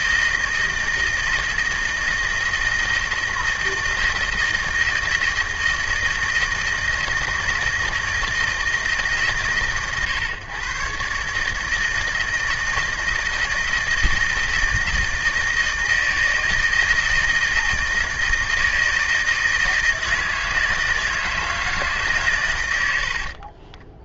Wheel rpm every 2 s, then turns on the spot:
160, 160, 160, 160, 150, 140, 160, 160, 160, 160, 160, 90.
none